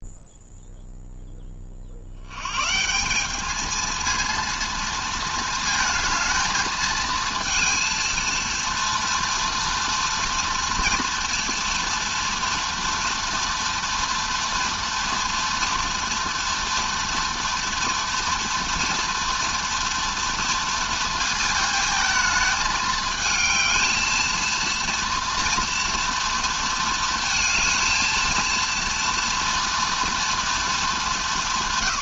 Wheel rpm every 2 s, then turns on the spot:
0, 160, 230, 220, 230, 240, 230, 230, 240, 230, 230, 220, 230, 220, 230, 220.
none